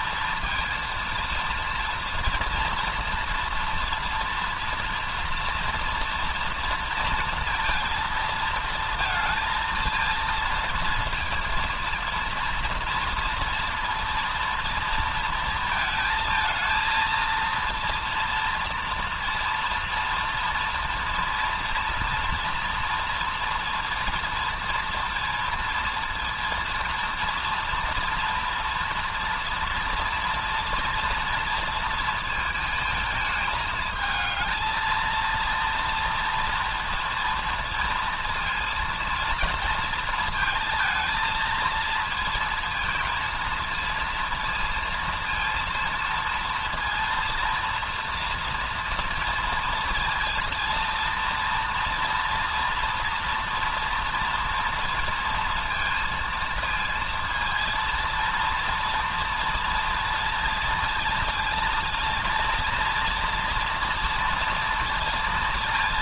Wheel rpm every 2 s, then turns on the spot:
230, 230, 230, 230, 230, 230, 230, 230, 230, 230, 230, 230, 230, 230, 230, 230, 220, 220, 230, 230, 220, 230, 230, 230, 230, 230, 230, 230, 230, 230, 230, 230, 230.
none